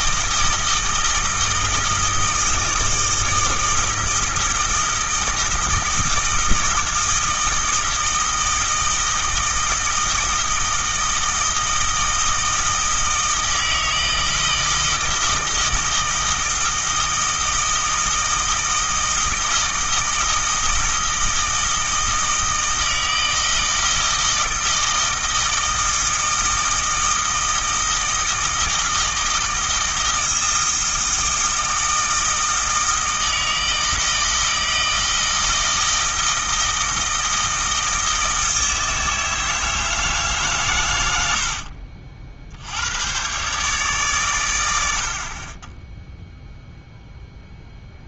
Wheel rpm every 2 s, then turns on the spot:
160, 160, 160, 160, 160, 160, 160, 160, 160, 160, 160, 160, 160, 160, 160, 160, 160, 160, 160, 160, 120, 90, 80, 0.
none